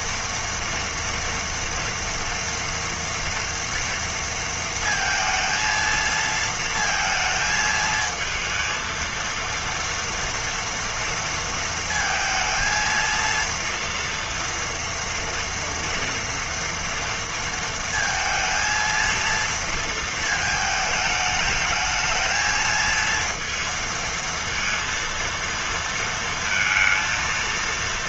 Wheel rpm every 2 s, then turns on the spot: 230, 230, 230, 230, 230, 230, 230, 230, 230, 230, 220, 230, 230, 230.
none